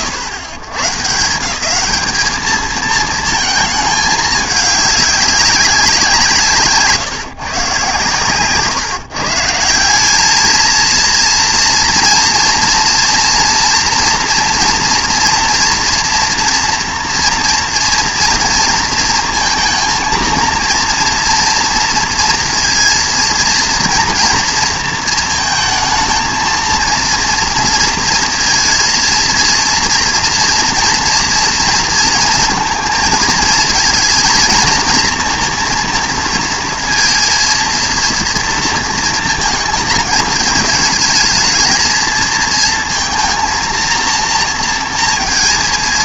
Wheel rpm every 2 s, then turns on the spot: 130, 220, 210, 140, 140, 230, 230, 240, 230, 230, 230, 230, 230, 230, 230, 230, 230, 230, 230, 230, 220, 230, 230.
none